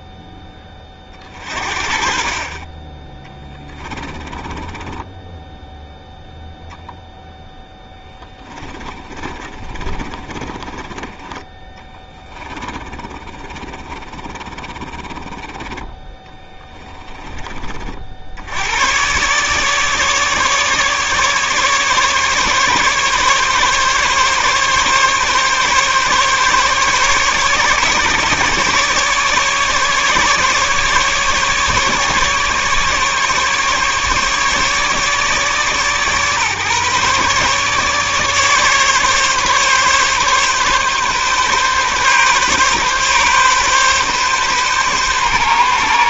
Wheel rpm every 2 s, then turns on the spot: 30, 30, 20, 0, 30, 20, 30, 30, 20, 120, 150, 140, 140, 140, 150, 150, 140, 150, 140, 140, 140, 130, 140.
4-6 8-18